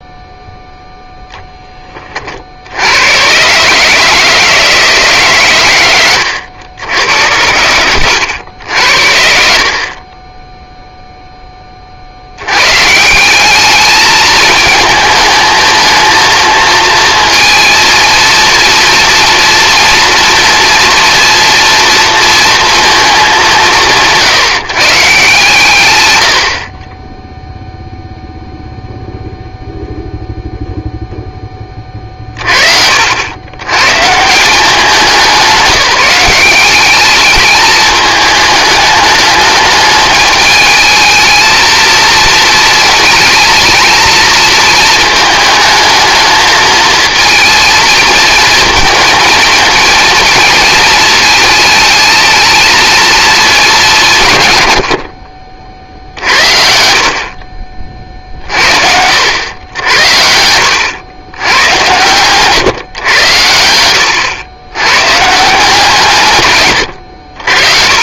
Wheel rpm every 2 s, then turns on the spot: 0, 70, 160, 90, 80, 0, 140, 220, 230, 230, 230, 230, 150, 40, 0, 0, 50, 190, 200, 210, 220, 230, 220, 220, 230, 230, 220, 90, 70, 60, 80, 130, 120, 110.
none